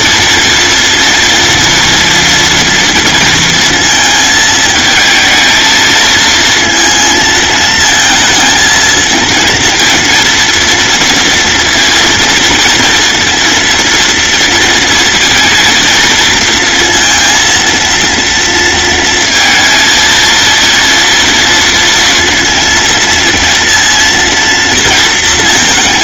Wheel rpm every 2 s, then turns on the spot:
230, 230, 220, 230, 230, 230, 230, 230, 230, 230, 230, 230, 230.
none